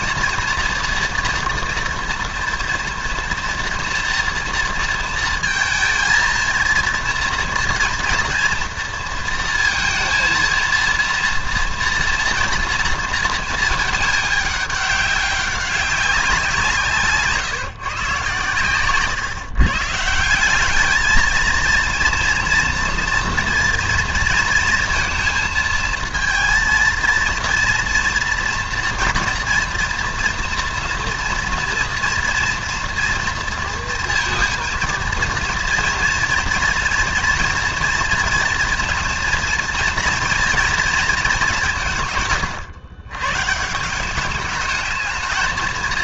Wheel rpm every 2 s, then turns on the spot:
240, 230, 230, 230, 240, 230, 230, 210, 170, 130, 180, 230, 230, 230, 230, 230, 240, 230, 240, 230, 230, 120, 210.
none